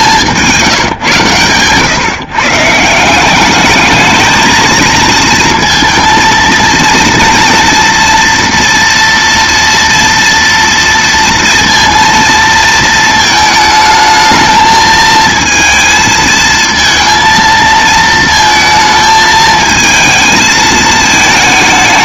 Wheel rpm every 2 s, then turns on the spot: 150, 150, 230, 230, 230, 230, 230, 220, 230, 220, 220.
none